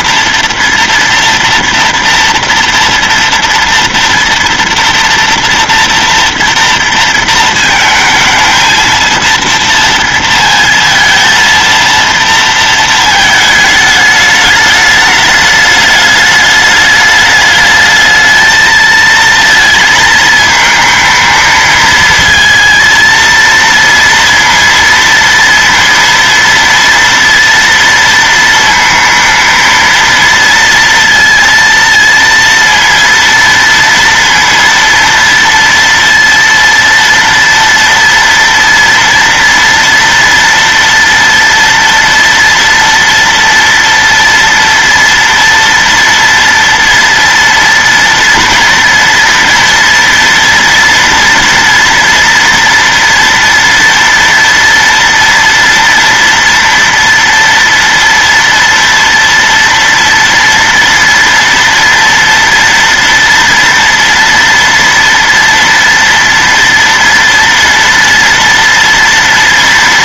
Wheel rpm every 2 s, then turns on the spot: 230, 230, 230, 230, 220, 230, 230, 210, 210, 220, 220, 230, 230, 230, 230, 230, 230, 230, 230, 230, 230, 230, 230, 230, 230, 230, 240, 230, 240, 230, 230, 230, 230, 230, 230.
none